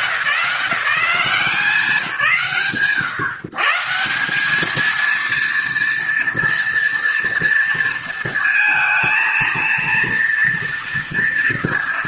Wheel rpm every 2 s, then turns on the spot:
190, 140, 230, 230, 230, 240.
none